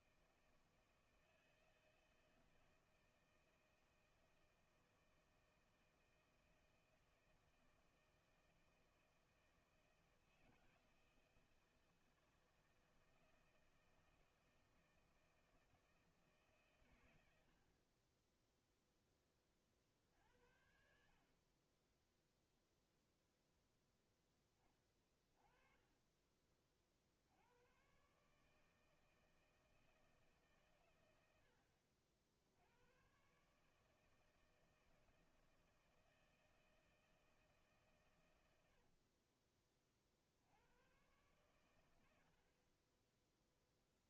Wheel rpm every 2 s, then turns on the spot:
160, 160, 160, 160, 160, 160, 160, 160, 130, 0, 60, 10, 20, 40, 150, 140, 80, 160, 160, 90, 70, 50.
38-40